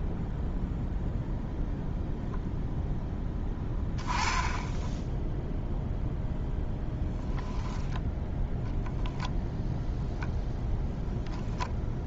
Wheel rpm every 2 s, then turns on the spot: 0, 0, 10, 0, 0, 0.
none